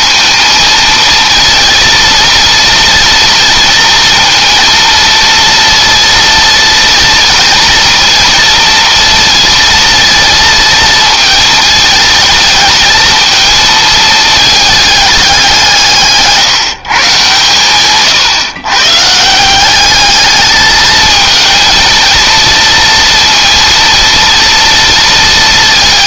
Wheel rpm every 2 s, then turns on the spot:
230, 230, 230, 230, 230, 230, 220, 210, 140, 130, 220, 230, 230.
none